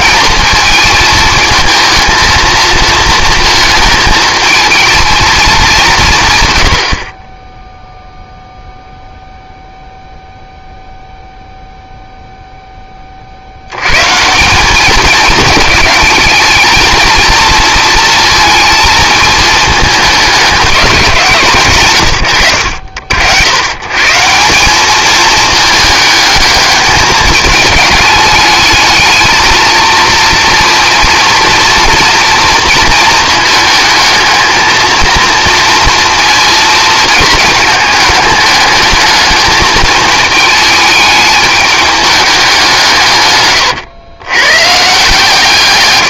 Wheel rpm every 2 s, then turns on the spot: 220, 230, 220, 90, 0, 0, 10, 190, 220, 230, 190, 80, 190, 210, 210, 230, 230, 220, 230, 210, 220, 180, 140.
none